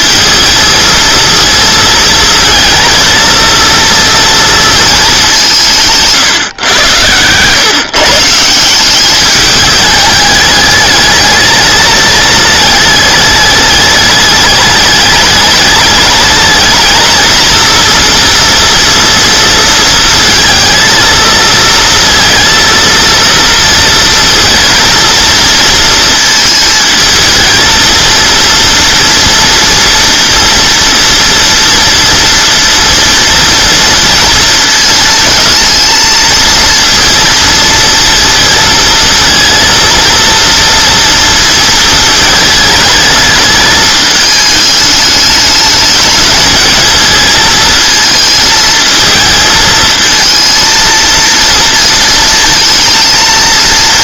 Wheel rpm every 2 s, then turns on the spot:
230, 220, 220, 120, 180, 210, 210, 210, 220, 230, 220, 230, 220, 220, 230, 240, 230, 230, 230, 220, 230, 220, 210, 220, 220, 230, 230.
none